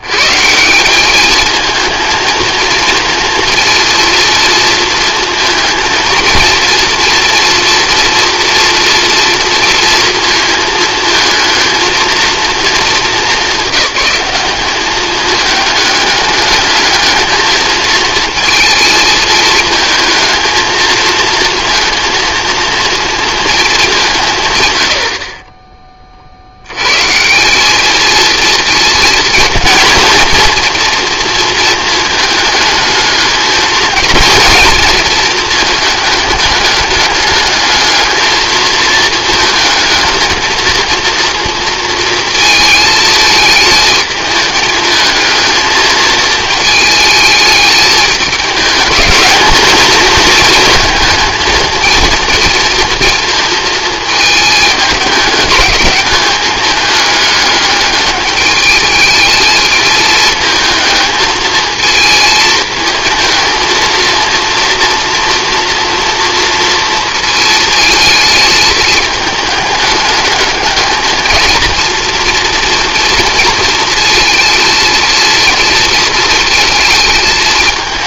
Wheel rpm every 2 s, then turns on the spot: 190, 230, 230, 230, 230, 220, 220, 210, 210, 220, 230, 230, 100, 120, 220, 230, 220, 230, 210, 220, 230, 220, 220, 220, 210, 220, 230, 210, 210, 220, 220, 220, 230, 230, 220, 210, 230, 230, 220.
none